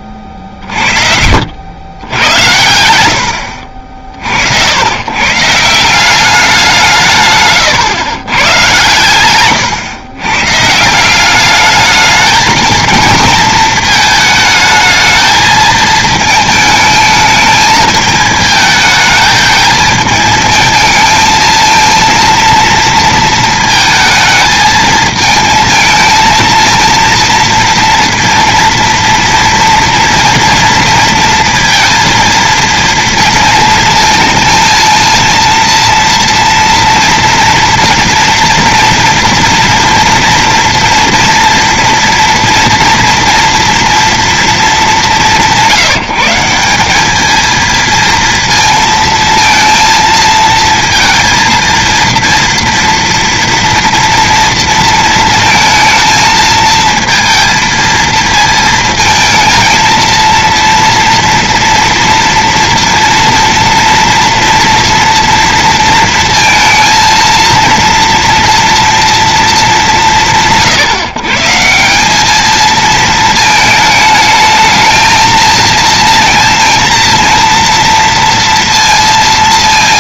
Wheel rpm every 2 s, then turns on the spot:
30, 100, 70, 190, 120, 130, 230, 220, 220, 220, 220, 230, 220, 230, 230, 230, 230, 230, 230, 230, 240, 230, 220, 180, 230, 230, 230, 230, 220, 220, 230, 230, 230, 230, 230, 150, 220, 220, 230, 230.
none